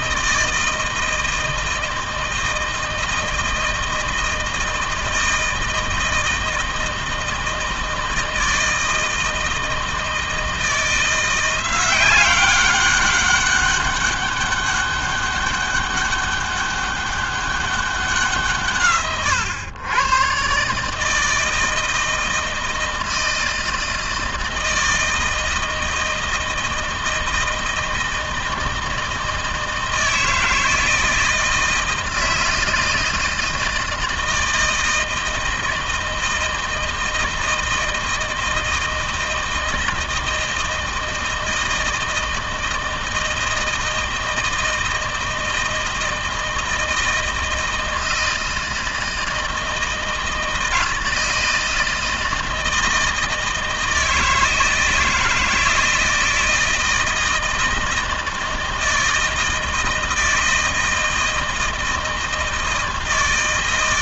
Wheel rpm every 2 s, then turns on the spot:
160, 160, 160, 160, 160, 170, 200, 200, 200, 140, 140, 160, 160, 160, 160, 160, 160, 160, 160, 160, 160, 160, 160, 160, 160, 160, 160, 160, 160, 160, 160, 160.
none